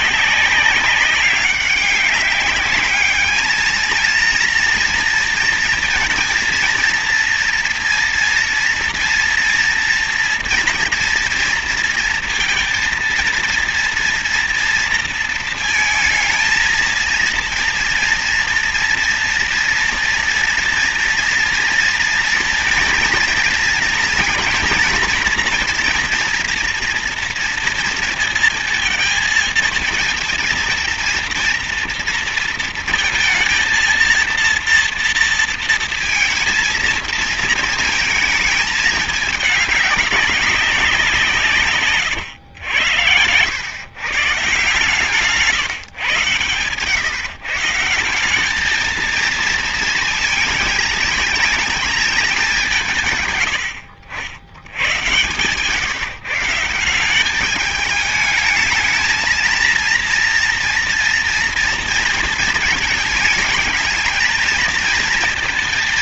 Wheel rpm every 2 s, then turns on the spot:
200, 200, 230, 230, 230, 230, 230, 230, 230, 230, 230, 230, 230, 230, 220, 230, 230, 230, 230, 210, 180, 90, 150, 120, 220, 230, 180, 100, 170, 220, 230, 220, 230.
42-44